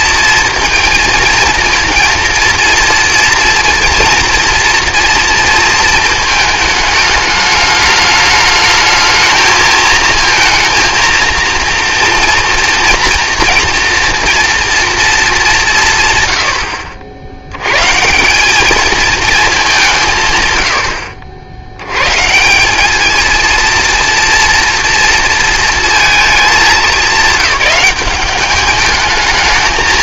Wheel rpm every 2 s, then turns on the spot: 230, 230, 230, 220, 210, 230, 230, 230, 70, 210, 110, 190, 240, 200, 200.
none